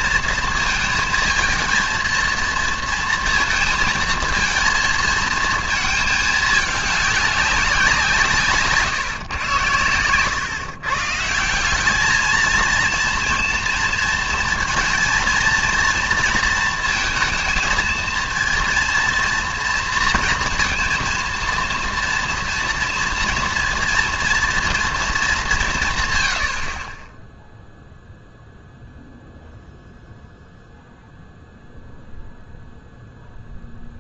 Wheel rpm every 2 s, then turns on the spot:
230, 230, 220, 220, 150, 130, 230, 220, 230, 230, 230, 230, 240, 60, 0, 0, 0.
none